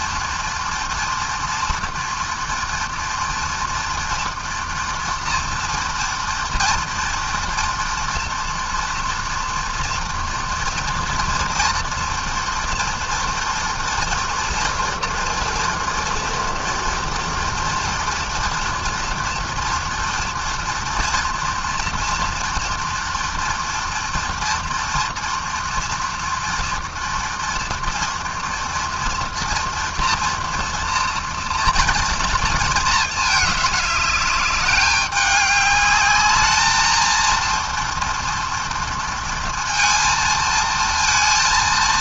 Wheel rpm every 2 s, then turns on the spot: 230, 230, 230, 230, 230, 230, 230, 230, 230, 240, 230, 230, 240, 230, 230, 240, 220, 200, 230, 230, 230.
none